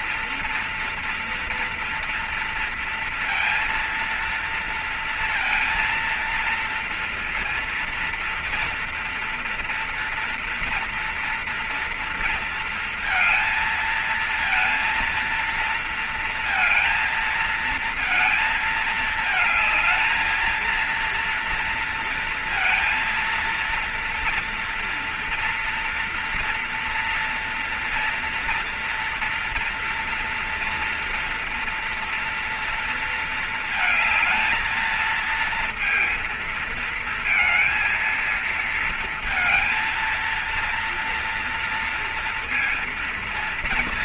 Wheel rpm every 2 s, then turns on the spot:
230, 230, 230, 230, 230, 240, 230, 230, 230, 220, 230, 230, 230, 230, 230, 230, 230, 220, 230, 230, 230, 230.
none